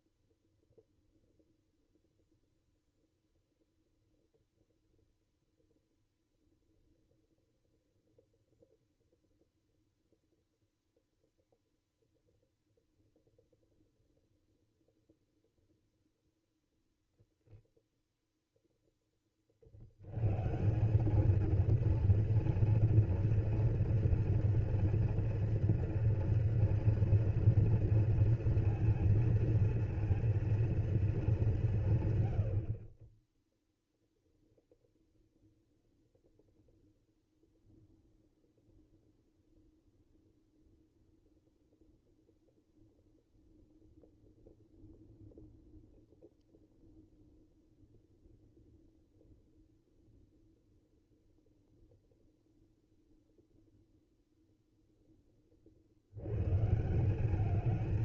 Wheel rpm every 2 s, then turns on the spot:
0, 0, 0, 0, 0, 0, 0, 0, 0, 0, 170, 230, 230, 230, 230, 230, 40, 0, 0, 0, 0, 0, 0, 0, 0, 0, 0, 0, 150.
none